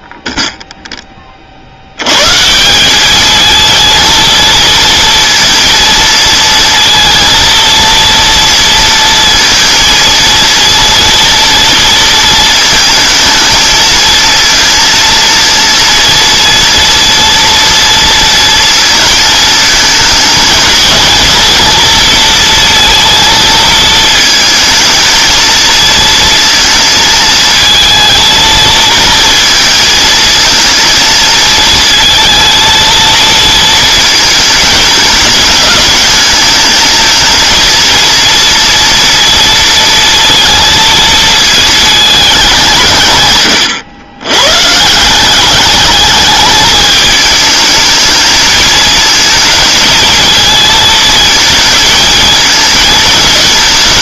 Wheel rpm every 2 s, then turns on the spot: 0, 190, 230, 230, 230, 230, 220, 230, 230, 220, 220, 230, 220, 230, 220, 230, 230, 210, 220, 230, 230, 160, 140, 210, 220, 220, 220.
none